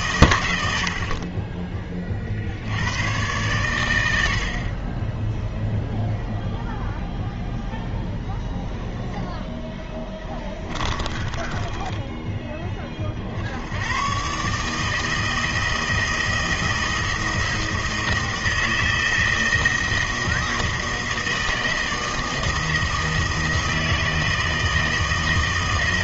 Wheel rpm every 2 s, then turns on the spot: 80, 80, 40, 0, 0, 10, 20, 150, 160, 160, 160, 160, 160.
10-12